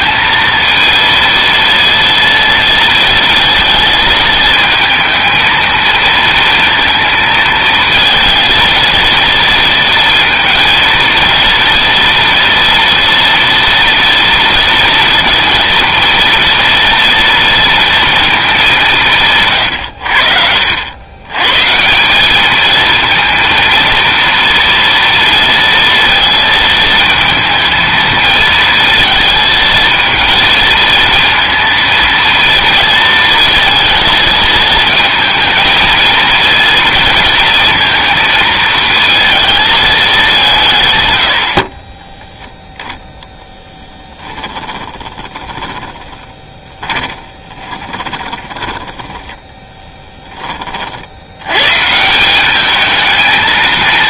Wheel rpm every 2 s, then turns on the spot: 230, 230, 220, 230, 230, 230, 230, 230, 230, 200, 80, 220, 230, 220, 220, 230, 230, 220, 230, 230, 160, 0, 20, 20, 20, 40, 210.
44-50